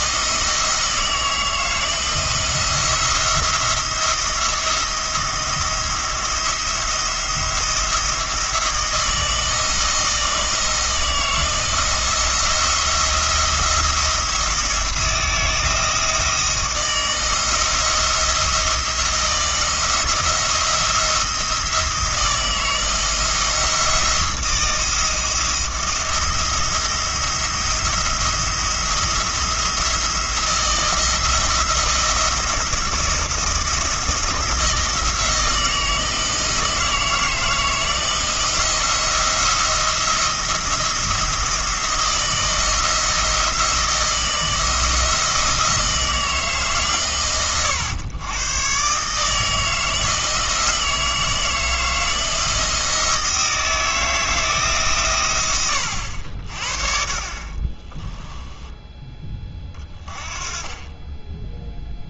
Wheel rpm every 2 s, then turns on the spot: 160, 170, 170, 170, 160, 160, 170, 170, 160, 160, 170, 170, 170, 170, 170, 170, 170, 170, 160, 170, 170, 160, 160, 130, 140, 160, 160, 130, 40, 10, 20.
none